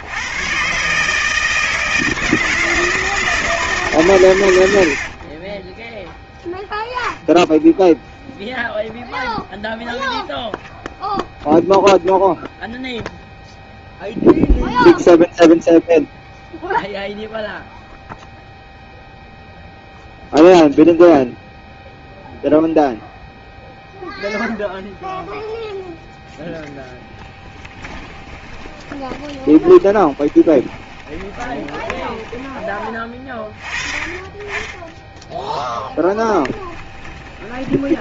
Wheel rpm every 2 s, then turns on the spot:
140, 160, 80, 0, 0, 0, 0, 0, 0, 0, 0, 0, 0, 0, 20, 20, 20, 20, 20.
4-6 28-32 36-38